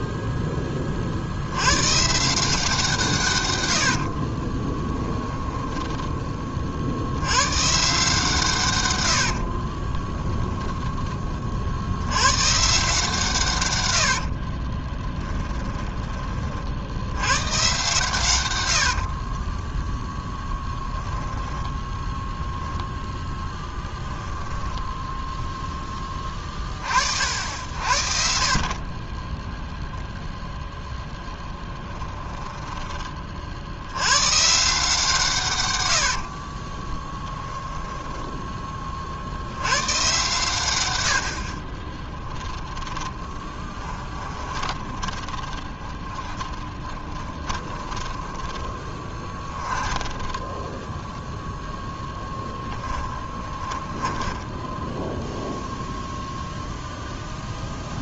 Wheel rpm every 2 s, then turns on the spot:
10, 160, 20, 30, 130, 10, 130, 40, 30, 110, 10, 10, 10, 30, 40, 0, 10, 140, 40, 20, 130, 10, 20, 20, 20, 20, 10, 10, 0.
4-6 10-12 14-16 24-26 32-34 36-38 42-56